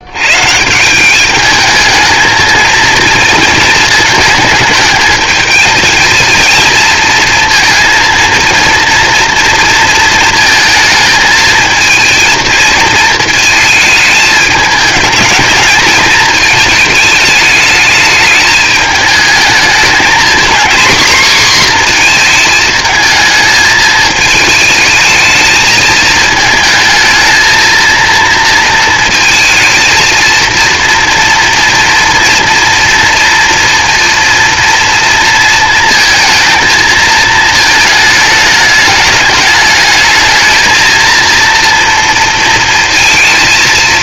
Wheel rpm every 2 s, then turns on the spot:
170, 220, 220, 230, 230, 220, 220, 210, 210, 210, 240, 220, 220, 220, 230, 230, 230, 230, 220, 210, 220, 230.
none